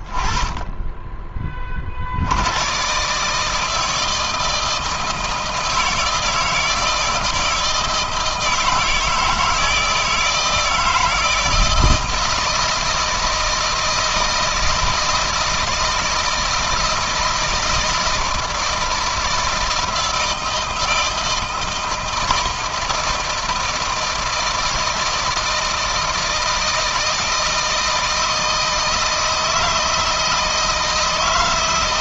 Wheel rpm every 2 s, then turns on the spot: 20, 120, 160, 160, 160, 160, 160, 160, 160, 160, 160, 170, 160, 160, 160, 160.
none